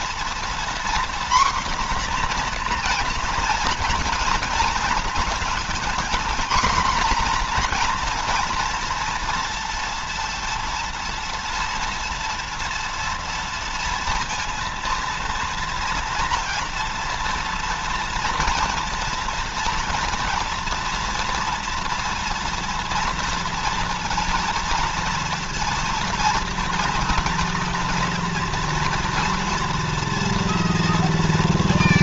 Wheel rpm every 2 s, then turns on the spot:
250, 240, 230, 240, 230, 230, 230, 230, 230, 230, 240, 230, 230, 230, 230, 230.
none